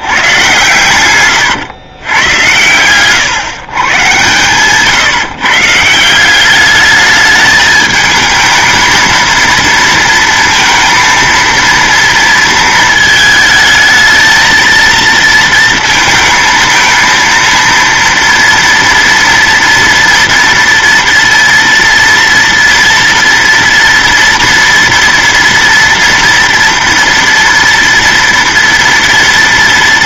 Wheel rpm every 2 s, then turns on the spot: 120, 120, 140, 210, 220, 230, 220, 230, 230, 230, 230, 230, 230, 230, 230.
none